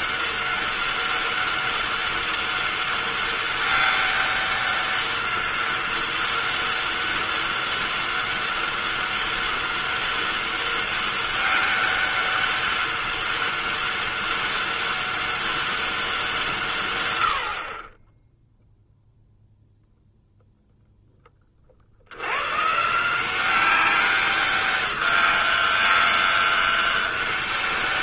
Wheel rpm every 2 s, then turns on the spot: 200, 200, 200, 200, 200, 200, 200, 200, 130, 0, 0, 130, 200, 200.
none